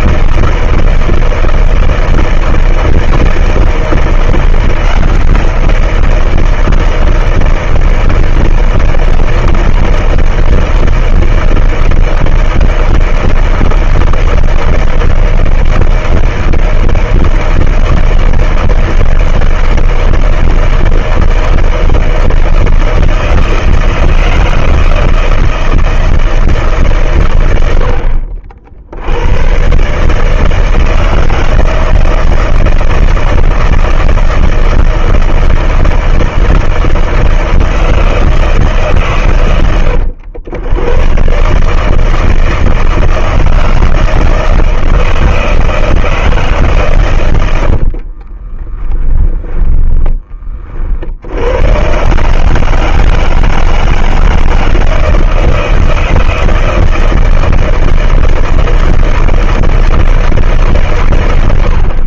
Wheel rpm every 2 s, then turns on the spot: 160, 160, 170, 170, 160, 160, 160, 160, 160, 160, 160, 160, 160, 160, 60, 160, 160, 160, 160, 160, 90, 160, 160, 150, 40, 20, 140, 160, 160, 160, 160.
48-50